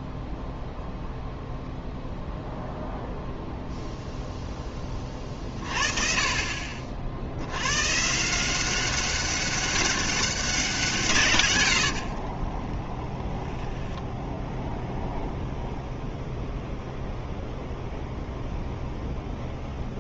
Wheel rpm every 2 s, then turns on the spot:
0, 0, 10, 60, 190, 180, 20, 0, 0, 0.
12-14